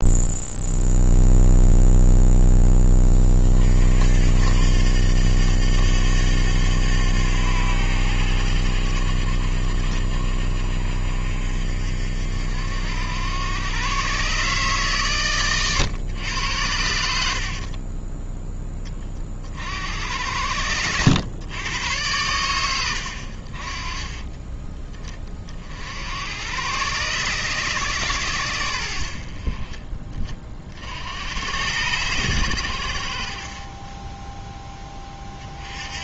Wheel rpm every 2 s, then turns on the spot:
0, 0, 80, 90, 80, 50, 70, 130, 80, 20, 90, 100, 20, 110, 90, 40, 100, 10.
none